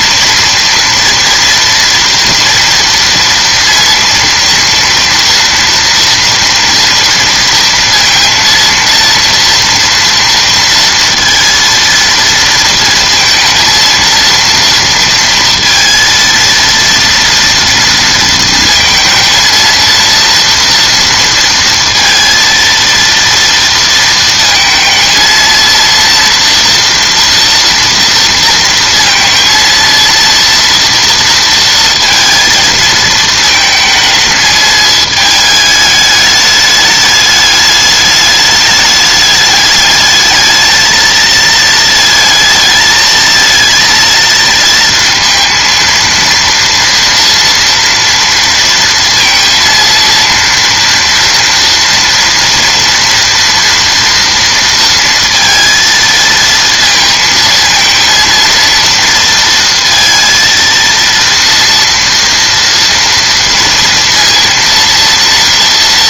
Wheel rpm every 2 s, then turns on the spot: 230, 230, 230, 230, 230, 230, 230, 230, 230, 230, 230, 230, 230, 230, 230, 230, 220, 220, 210, 210, 220, 220, 230, 240, 230, 230, 230, 230, 230, 230, 230, 230, 230.
none